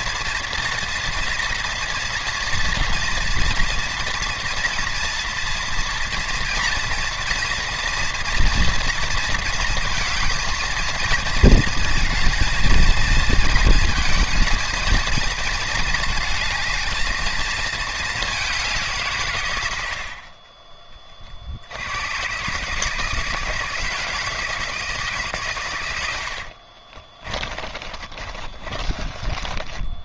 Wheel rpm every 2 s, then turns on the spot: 230, 230, 230, 230, 230, 230, 220, 230, 220, 180, 20, 140, 160, 50, 30.
26-30